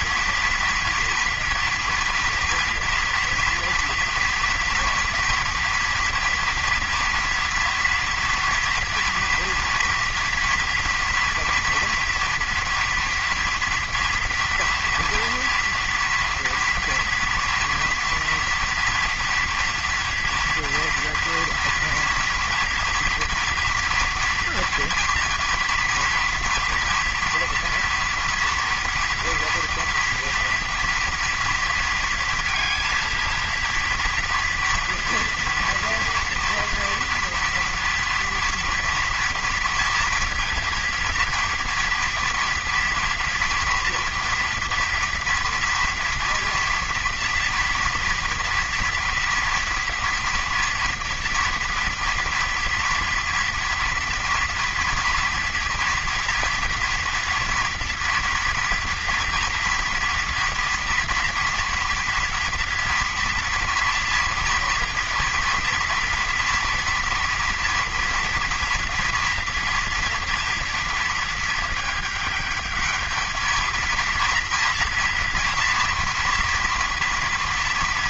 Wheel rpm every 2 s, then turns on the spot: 240, 230, 230, 230, 230, 230, 230, 230, 230, 230, 230, 230, 230, 230, 240, 230, 230, 230, 230, 230, 230, 230, 240, 230, 240, 230, 230, 240, 230, 230, 230, 230, 230, 230, 230, 230, 210, 240, 230.
none